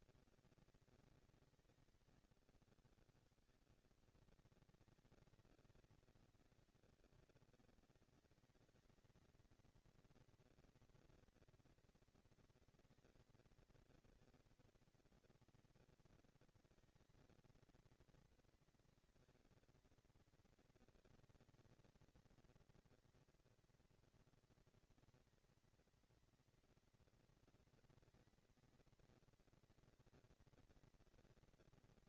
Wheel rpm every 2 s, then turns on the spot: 220, 200, 200, 190, 210, 230, 230, 230, 230, 230, 230, 230, 230, 230, 230, 230.
none